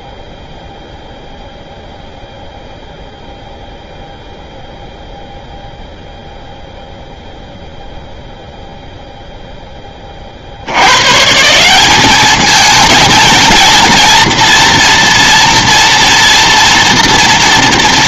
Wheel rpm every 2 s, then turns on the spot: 0, 0, 0, 0, 0, 40, 210, 230, 240.
none